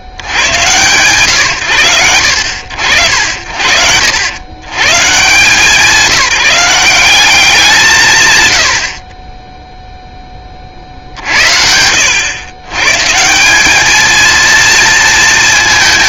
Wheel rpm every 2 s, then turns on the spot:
80, 60, 120, 180, 70, 40, 130, 210.
none